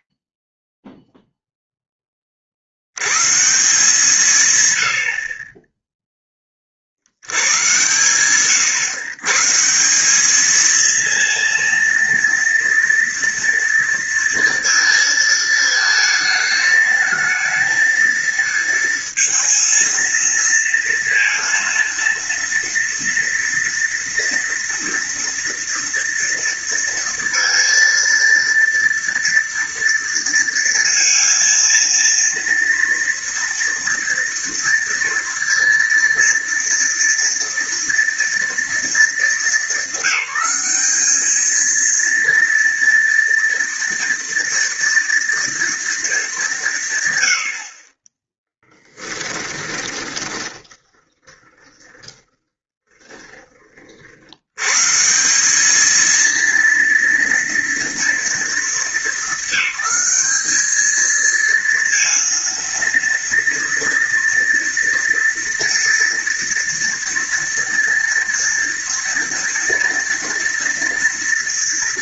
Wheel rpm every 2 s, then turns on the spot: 10, 20, 150, 10, 120, 210, 230, 230, 220, 220, 230, 230, 230, 230, 230, 230, 230, 230, 230, 230, 190, 230, 230, 170, 10, 20, 10, 150, 230, 220, 220, 230, 230, 230, 230, 230.
48-54